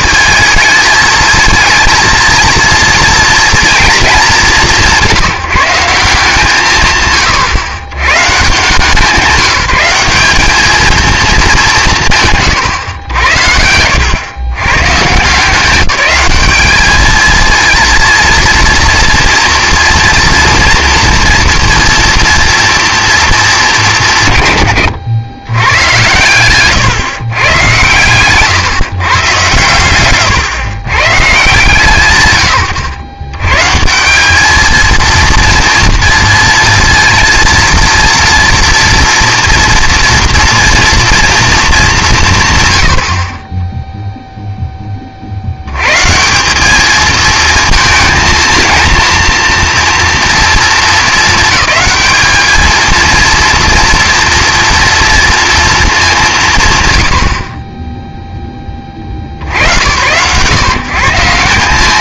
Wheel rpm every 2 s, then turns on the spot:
220, 230, 180, 150, 160, 220, 130, 120, 210, 240, 230, 230, 120, 110, 140, 120, 120, 220, 230, 230, 230, 140, 10, 200, 230, 230, 220, 230, 130, 20, 130.
none